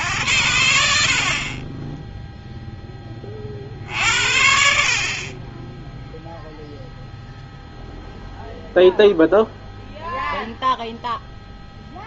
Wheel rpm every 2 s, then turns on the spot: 70, 0, 60, 0, 0, 0.
none